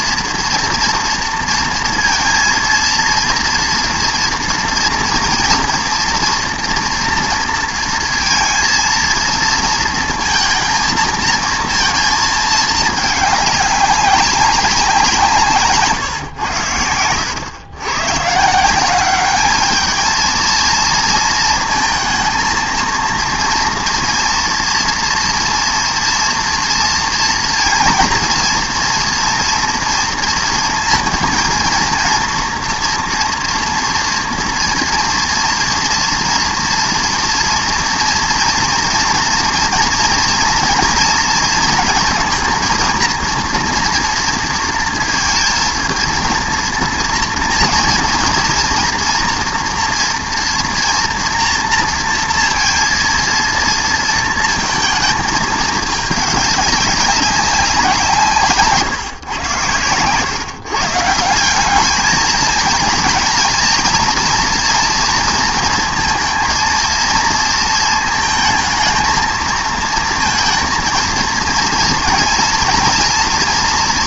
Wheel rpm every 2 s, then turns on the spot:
230, 230, 240, 230, 230, 230, 220, 190, 100, 160, 230, 230, 230, 230, 230, 230, 230, 230, 240, 230, 240, 230, 230, 230, 230, 230, 230, 220, 200, 150, 140, 220, 230, 230, 230, 230, 230.
none